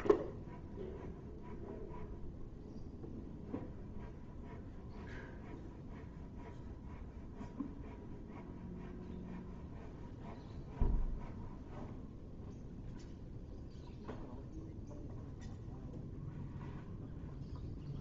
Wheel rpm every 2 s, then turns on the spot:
0, 0, 0, 0, 0, 0, 0, 0, 0.
none